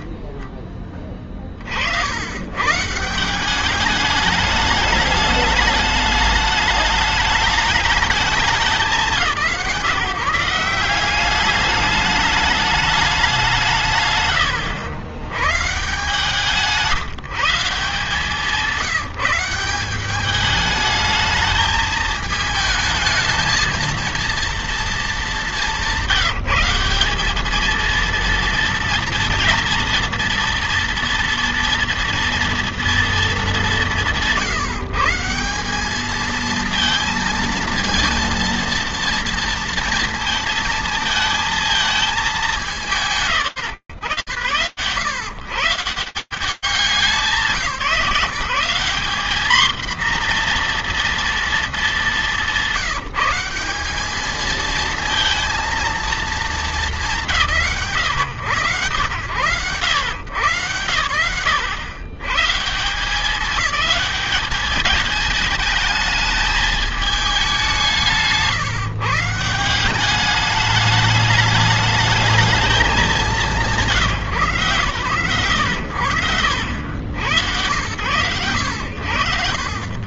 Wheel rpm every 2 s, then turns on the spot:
20, 110, 210, 210, 180, 170, 210, 100, 170, 180, 210, 220, 230, 190, 230, 230, 230, 140, 220, 230, 230, 210, 120, 180, 220, 240, 180, 230, 200, 110, 100, 190, 210, 200, 160, 210, 200, 120, 110, 80.
none